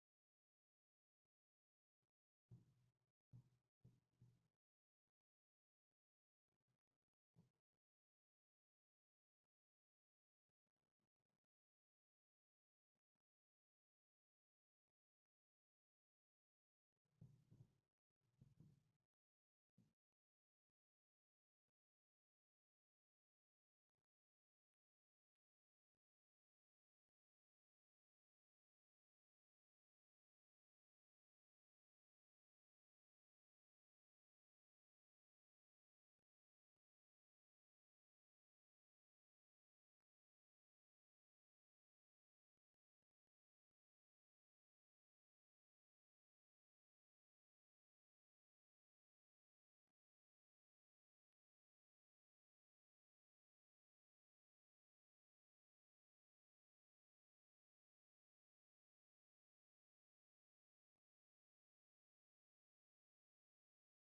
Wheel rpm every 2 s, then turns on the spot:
0, 0, 0, 0, 0, 0, 0, 0, 0, 0, 0, 0, 0, 0, 0, 0, 0, 0, 0, 0, 0, 0, 0, 0, 0, 0, 0, 0, 0, 0, 0, 0.
none